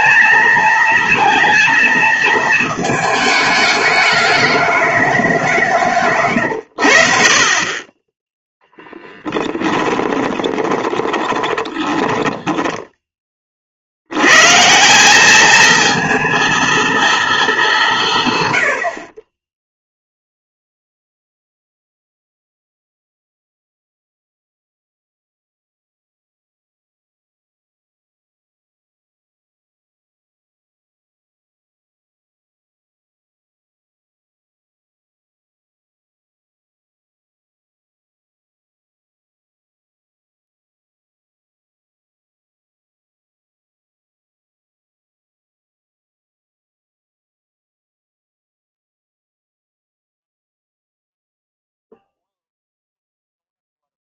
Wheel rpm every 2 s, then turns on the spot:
230, 220, 210, 90, 0, 20, 10, 150, 230, 90, 0, 0, 0, 0, 0, 0, 0, 0, 0, 0, 0, 0, 0, 0, 0, 0, 0.
10-14